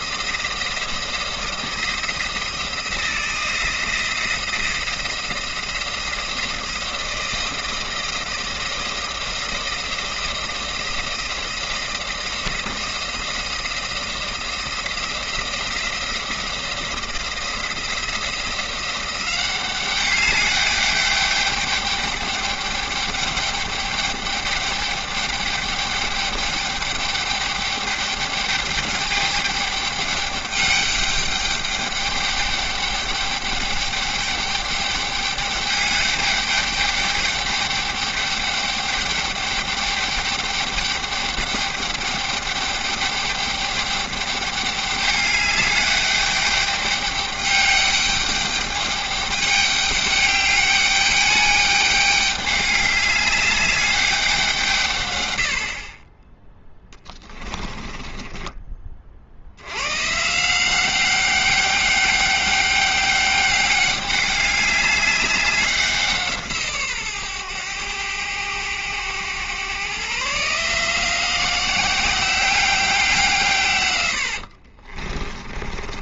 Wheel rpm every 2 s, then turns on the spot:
170, 170, 160, 170, 170, 170, 170, 170, 170, 180, 200, 200, 200, 200, 200, 200, 210, 210, 210, 210, 210, 210, 210, 200, 200, 210, 200, 150, 10, 30, 180, 200, 200, 140, 100, 160, 180, 40.
56-58 74-76